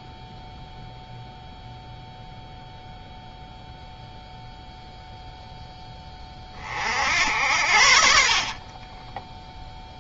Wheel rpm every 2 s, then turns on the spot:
0, 0, 0, 50, 20.
8-10